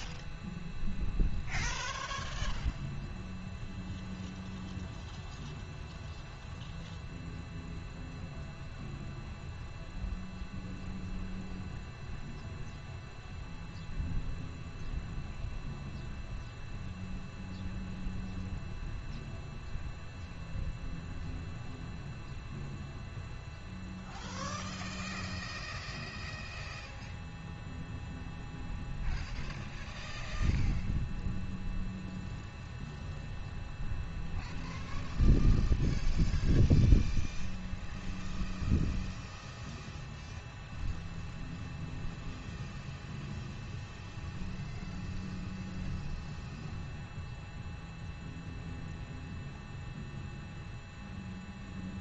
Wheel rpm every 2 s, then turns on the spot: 0, 0, 0, 0, 0, 0, 0, 0, 0, 0, 0, 0, 0, 0, 0, 0, 0, 0, 0, 0, 0, 0, 0, 0, 0, 0.
none